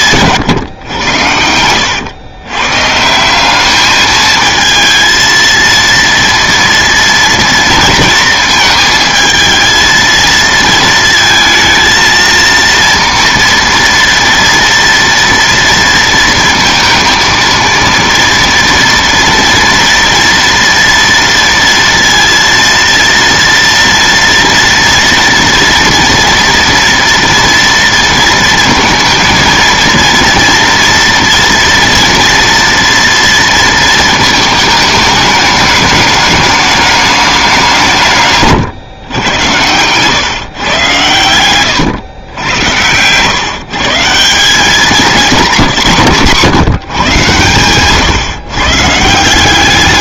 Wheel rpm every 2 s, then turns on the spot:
140, 130, 220, 230, 230, 220, 230, 230, 230, 230, 230, 230, 230, 230, 230, 230, 230, 220, 210, 130, 120, 100, 190, 140, 140.
none